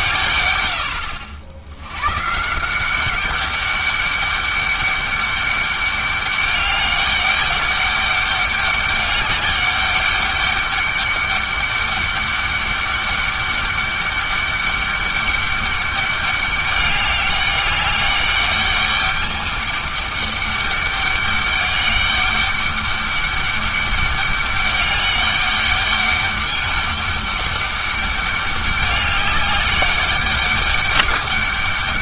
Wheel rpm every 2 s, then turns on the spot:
100, 180, 200, 200, 200, 200, 200, 200, 200, 210, 200, 200, 200, 210, 200, 200.
none